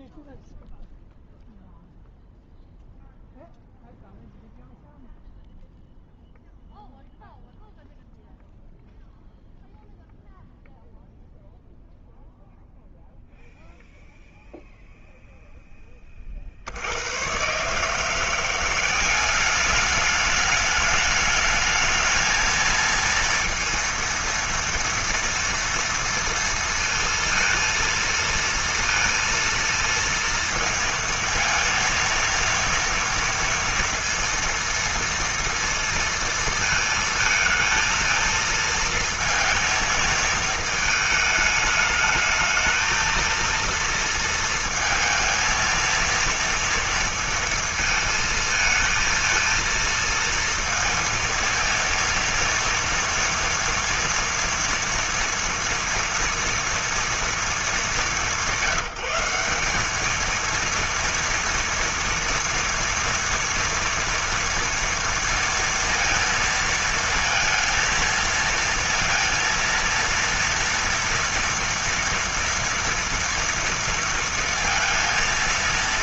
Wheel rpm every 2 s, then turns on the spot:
0, 0, 0, 0, 0, 0, 0, 0, 80, 190, 210, 230, 230, 230, 230, 230, 230, 230, 220, 230, 220, 230, 230, 230, 230, 230, 230, 230, 230, 190, 230, 230, 230, 230, 230, 230, 230, 230.
none